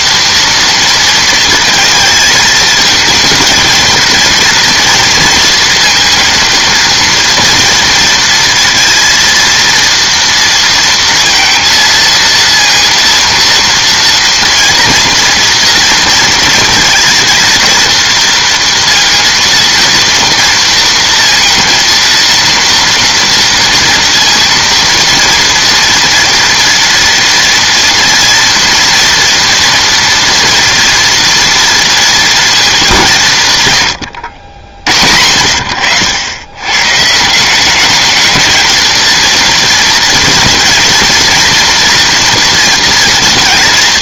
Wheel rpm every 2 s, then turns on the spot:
230, 220, 230, 230, 230, 230, 230, 230, 230, 230, 230, 230, 230, 230, 240, 230, 210, 80, 100, 220, 230, 240.
none